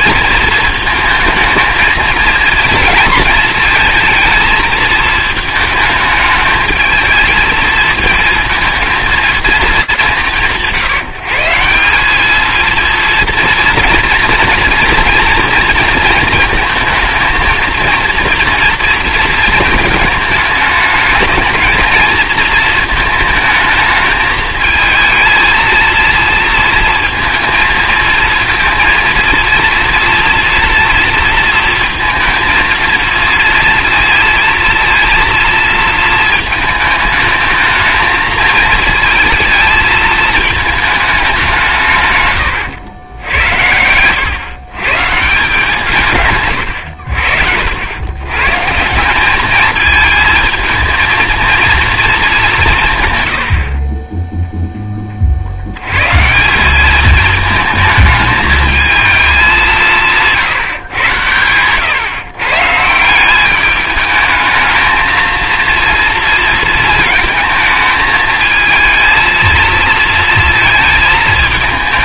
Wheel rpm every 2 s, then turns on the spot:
220, 230, 220, 220, 220, 160, 220, 230, 230, 230, 210, 220, 220, 230, 230, 230, 230, 230, 220, 220, 220, 110, 140, 110, 160, 230, 160, 0, 180, 220, 150, 150, 220, 220, 220, 230.
none